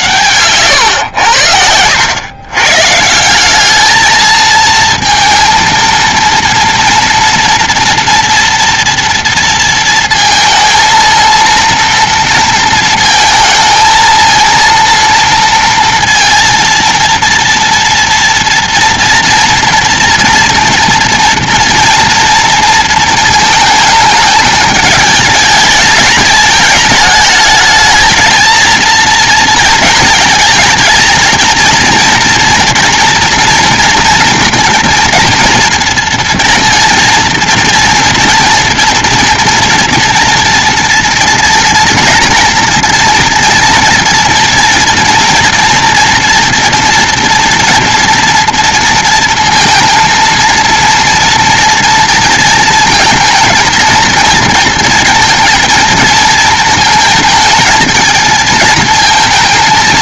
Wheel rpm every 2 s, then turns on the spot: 120, 120, 220, 230, 240, 220, 230, 220, 230, 230, 230, 230, 210, 210, 230, 220, 230, 240, 240, 230, 240, 240, 230, 240, 230, 230, 230, 230, 220, 220.
none